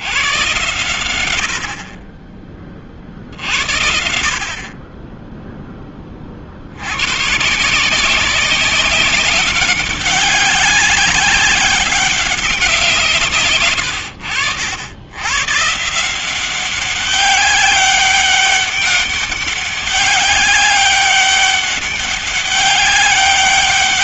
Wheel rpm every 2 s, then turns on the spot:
40, 70, 10, 160, 200, 190, 120, 140, 200, 200, 200, 200.
none